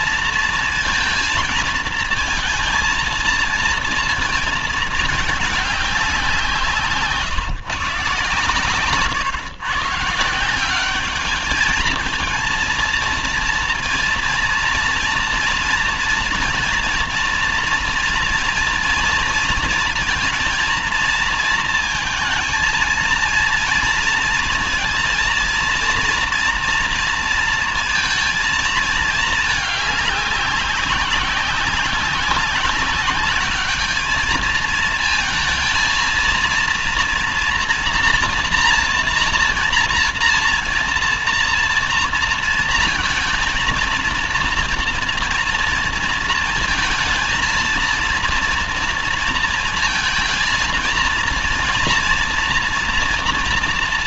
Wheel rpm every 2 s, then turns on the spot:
230, 230, 220, 160, 130, 180, 230, 230, 230, 230, 230, 230, 230, 230, 220, 200, 190, 220, 230, 230, 240, 230, 230, 220, 230, 230, 240.
none